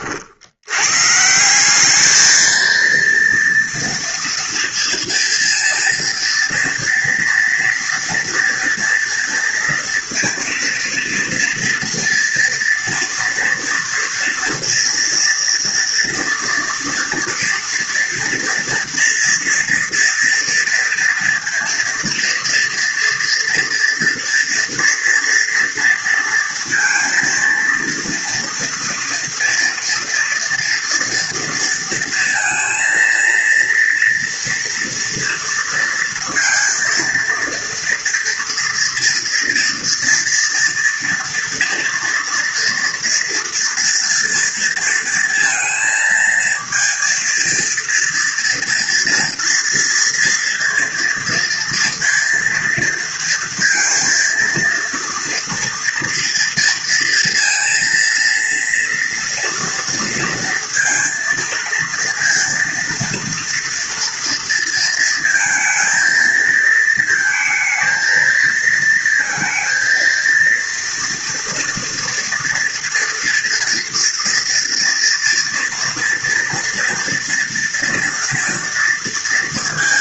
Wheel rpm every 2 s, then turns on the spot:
80, 220, 230, 230, 230, 230, 230, 230, 230, 230, 230, 240, 240, 230, 230, 230, 230, 240, 230, 230, 230, 230, 230, 230, 230, 230, 230, 230, 230, 230, 230, 230, 230, 230, 230, 230, 230, 230, 230, 230.
none